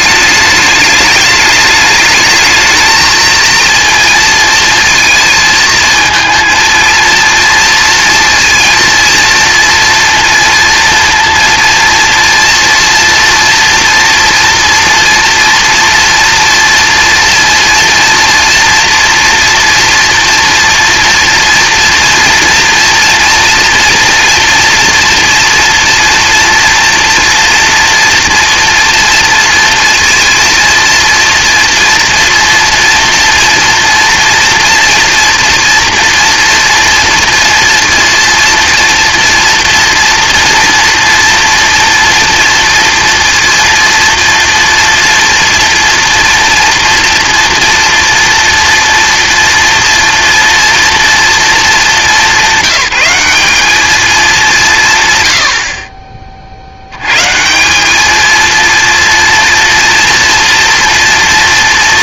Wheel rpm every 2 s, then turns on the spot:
210, 220, 230, 230, 230, 230, 240, 230, 230, 230, 230, 230, 230, 230, 230, 230, 230, 230, 230, 230, 230, 230, 230, 240, 240, 230, 200, 160, 80, 230, 230.
none